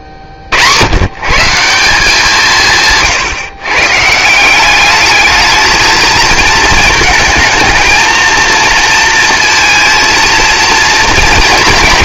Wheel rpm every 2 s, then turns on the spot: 70, 150, 210, 220, 230, 230.
2-4